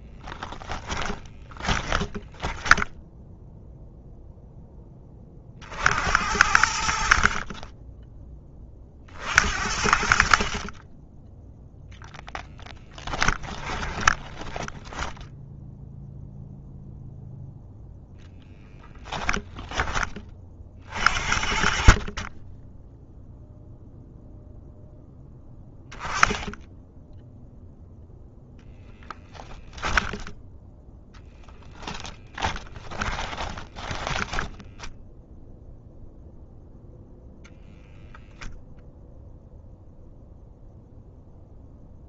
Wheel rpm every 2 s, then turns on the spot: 20, 0, 50, 20, 50, 0, 20, 10, 0, 10, 50, 0, 0, 0, 10, 0, 30, 10, 0, 0, 0.
0-2 12-14 18-20 28-30 32-34